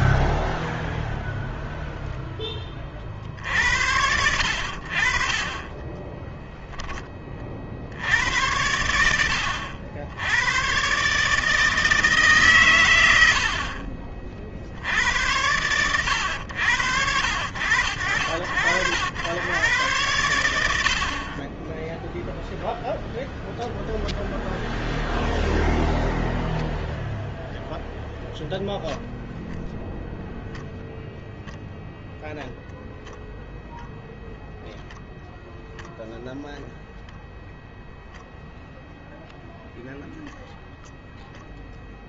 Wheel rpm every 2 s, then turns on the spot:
0, 10, 70, 20, 80, 100, 140, 50, 90, 70, 100, 0, 0, 0, 0, 0, 0, 0, 0, 0, 0.
6-8